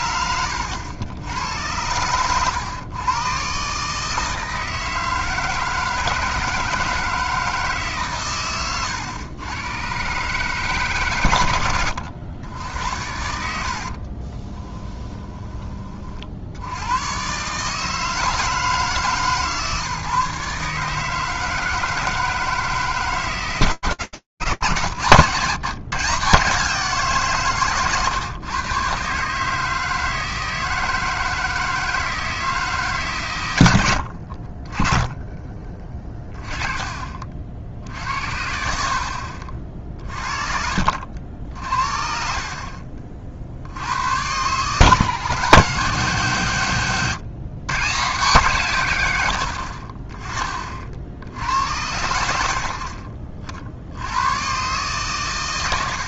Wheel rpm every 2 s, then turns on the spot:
80, 120, 160, 160, 120, 140, 80, 20, 70, 160, 150, 160, 130, 150, 140, 160, 120, 20, 40, 50, 50, 60, 160, 110, 90, 60, 50, 120.
14-16 34-36